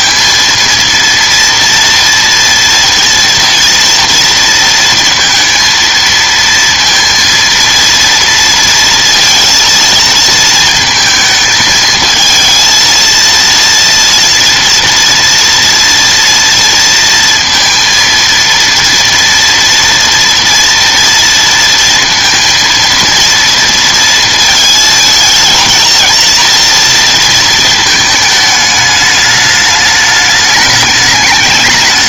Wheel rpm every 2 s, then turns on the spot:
230, 230, 230, 230, 230, 220, 230, 230, 230, 230, 230, 230, 220, 230, 210, 210.
none